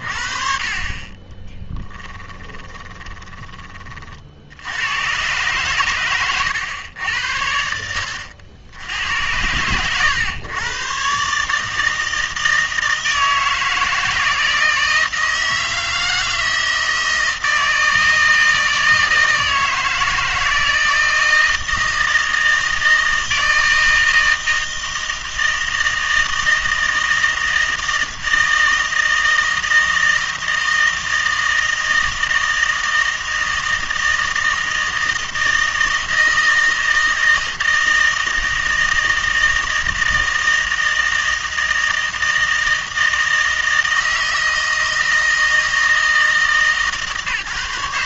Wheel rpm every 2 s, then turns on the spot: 40, 20, 90, 100, 80, 120, 160, 160, 160, 160, 160, 160, 160, 160, 160, 160, 160, 160, 160, 160, 160, 160, 160, 150.
2-4